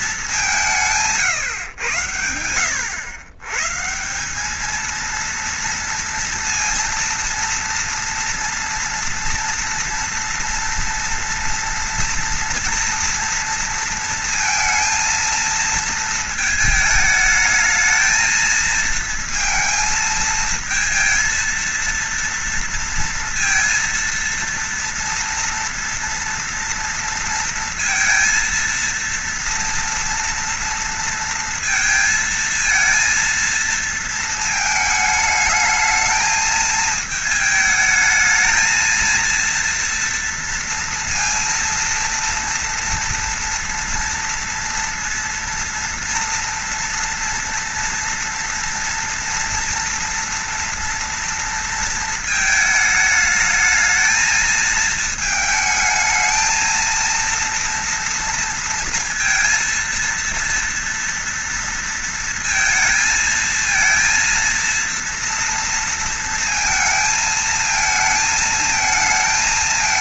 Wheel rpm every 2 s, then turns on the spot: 170, 90, 220, 240, 230, 240, 230, 230, 220, 230, 220, 230, 230, 230, 230, 230, 230, 220, 220, 220, 230, 230, 230, 230, 240, 230, 220, 220, 230, 230, 230, 230, 230, 230, 220.
none